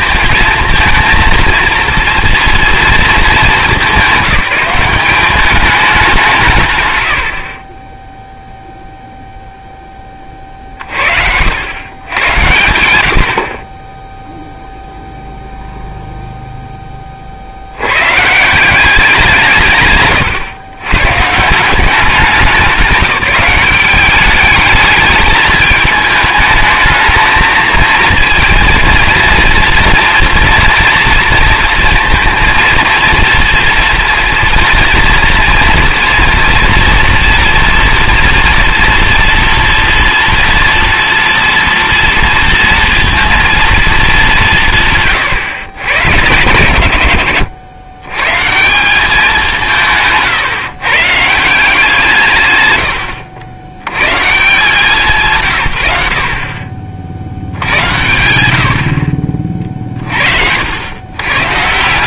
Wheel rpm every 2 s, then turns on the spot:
230, 230, 200, 120, 0, 50, 90, 0, 10, 180, 120, 190, 210, 220, 230, 230, 230, 230, 230, 230, 230, 230, 160, 100, 170, 140, 120, 170, 40, 70, 80.
none